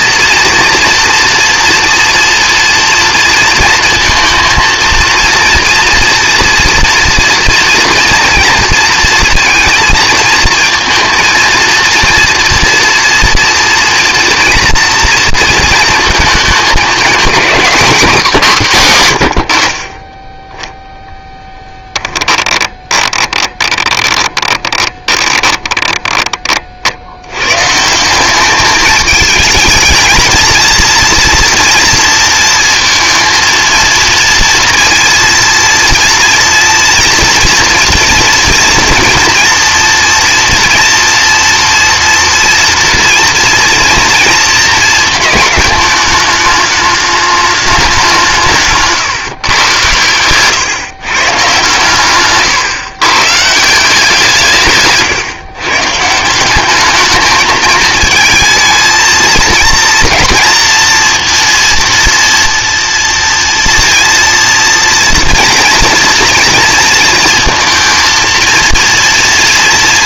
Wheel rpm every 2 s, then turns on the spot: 230, 230, 230, 230, 230, 230, 230, 230, 220, 200, 10, 20, 20, 40, 200, 230, 230, 230, 230, 240, 230, 230, 230, 210, 170, 120, 130, 160, 200, 220, 230, 230, 240, 230, 230.
22-26 50-52